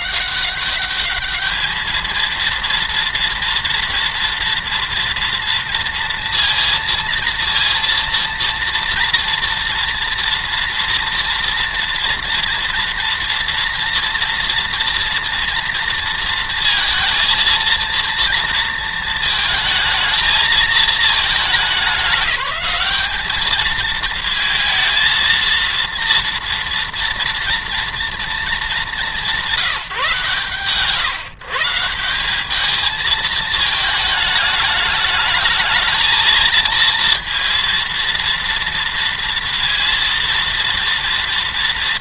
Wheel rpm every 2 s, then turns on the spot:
210, 230, 230, 230, 230, 240, 230, 230, 230, 230, 210, 210, 220, 230, 200, 130, 220, 210, 230, 230, 230.
none